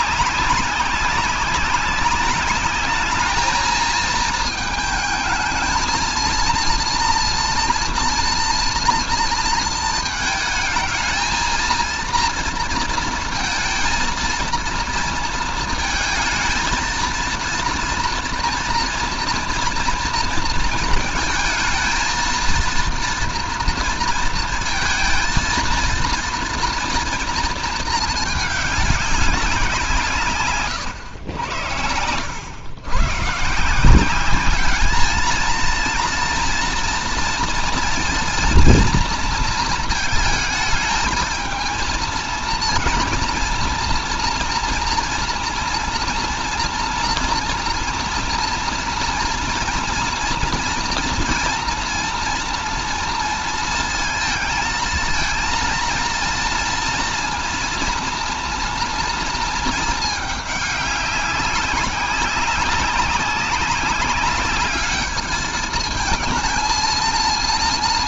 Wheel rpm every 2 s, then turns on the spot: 190, 210, 220, 230, 230, 220, 230, 230, 230, 230, 230, 230, 230, 230, 210, 110, 110, 210, 230, 230, 220, 230, 230, 240, 230, 230, 230, 230, 230, 230, 200, 200, 200, 220.
none